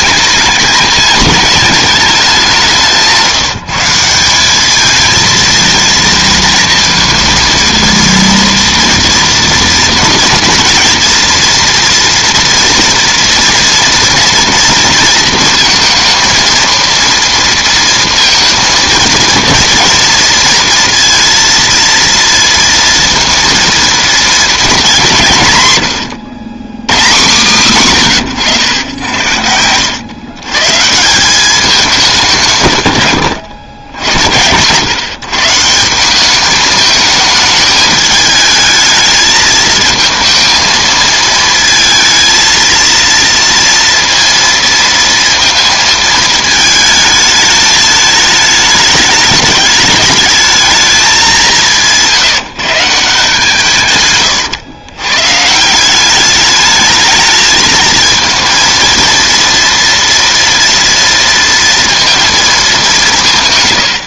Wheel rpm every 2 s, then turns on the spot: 220, 190, 210, 230, 230, 230, 230, 230, 230, 230, 230, 230, 220, 110, 110, 130, 130, 110, 210, 220, 220, 230, 230, 220, 210, 210, 150, 120, 210, 230, 230, 210.
28-30